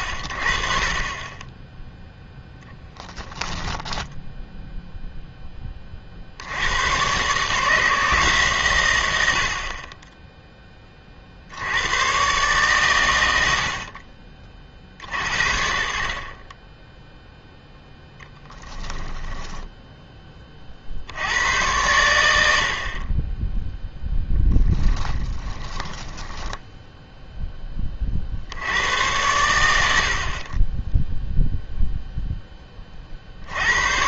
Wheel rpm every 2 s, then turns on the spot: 50, 10, 0, 90, 120, 20, 130, 50, 20, 10, 50, 60, 10, 20, 90, 10, 30.
2-4 18-20 24-28